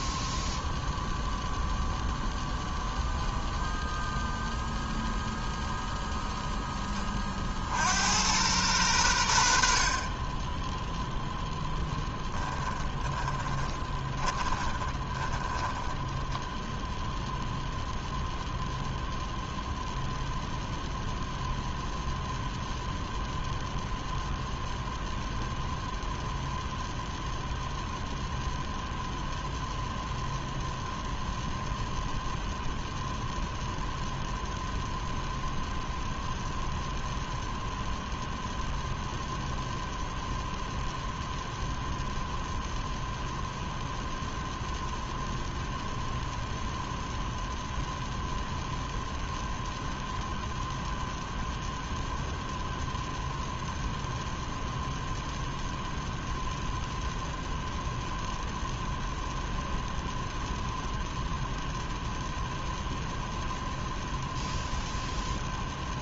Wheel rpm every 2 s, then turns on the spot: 0, 0, 0, 10, 100, 0, 10, 20, 0, 0, 0, 0, 0, 0, 0, 0, 0, 0, 0, 0, 0, 0, 0, 0, 0, 0, 0, 0, 0, 0, 0, 0, 0.
12-16